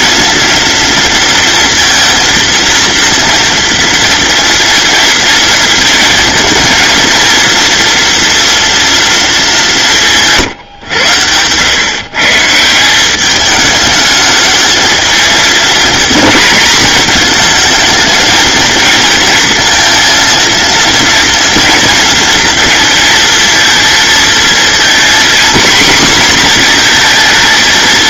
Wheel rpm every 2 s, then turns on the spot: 230, 230, 230, 230, 240, 140, 160, 220, 230, 230, 230, 230, 230, 240.
none